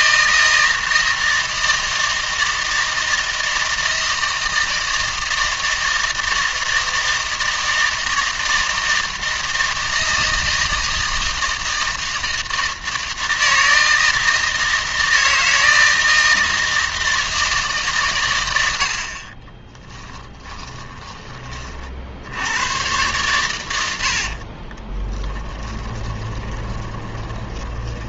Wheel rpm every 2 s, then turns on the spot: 160, 160, 160, 160, 160, 160, 160, 160, 160, 80, 10, 100, 40, 20.
20-22 24-28